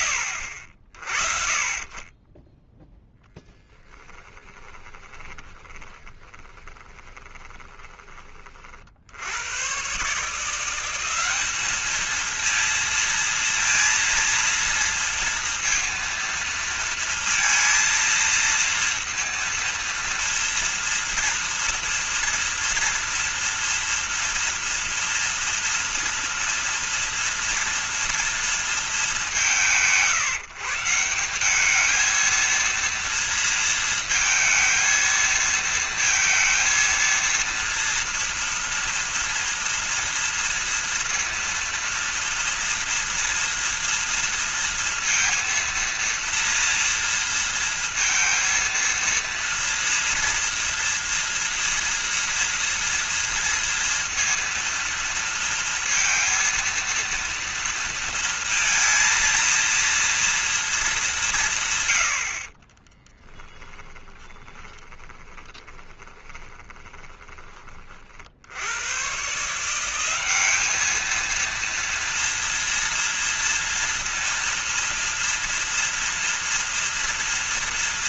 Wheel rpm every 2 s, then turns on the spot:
60, 10, 20, 20, 60, 190, 230, 230, 230, 230, 230, 230, 240, 230, 190, 170, 230, 220, 230, 230, 230, 230, 230, 230, 230, 240, 230, 230, 230, 230, 230, 50, 10, 20, 60, 200, 230, 230, 230.
4-8 62-68